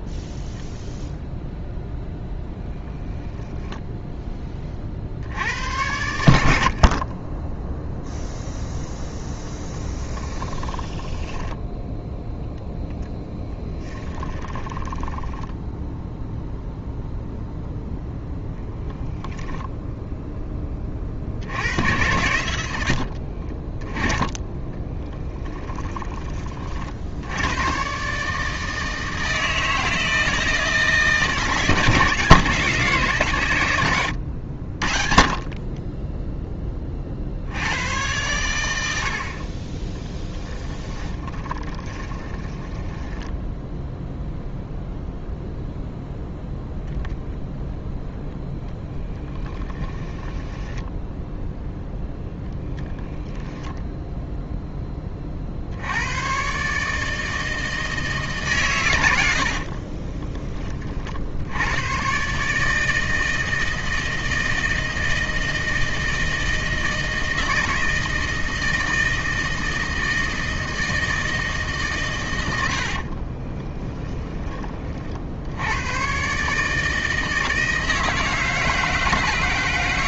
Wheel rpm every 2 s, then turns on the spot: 0, 10, 30, 60, 0, 10, 0, 10, 0, 0, 20, 80, 10, 50, 160, 160, 170, 60, 20, 90, 20, 10, 0, 0, 0, 10, 10, 10, 140, 120, 20, 150, 160, 160, 160, 160, 80, 30, 150, 160.
10-12 14-16 24-26 40-44 50-52 72-74